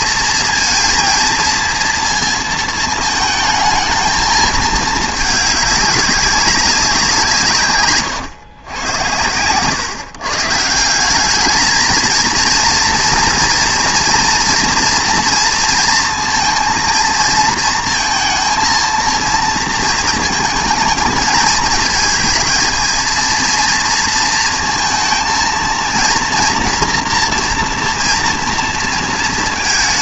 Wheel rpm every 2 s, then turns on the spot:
230, 220, 220, 190, 100, 180, 230, 230, 230, 230, 220, 220, 230, 240, 230.
none